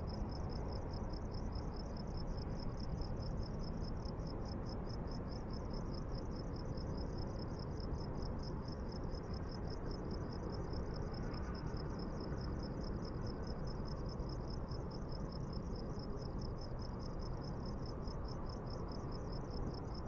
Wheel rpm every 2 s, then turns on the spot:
0, 0, 0, 0, 0, 0, 0, 0, 0, 0.
none